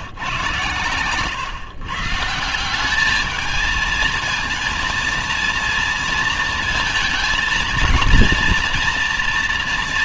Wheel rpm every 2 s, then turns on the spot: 130, 190, 230, 230, 230.
none